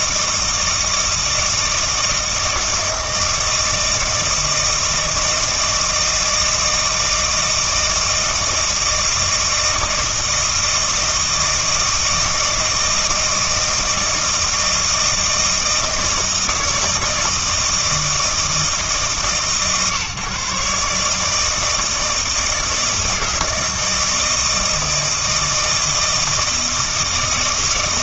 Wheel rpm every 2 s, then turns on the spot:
160, 160, 160, 160, 160, 160, 160, 160, 160, 150, 140, 160, 160, 160.
none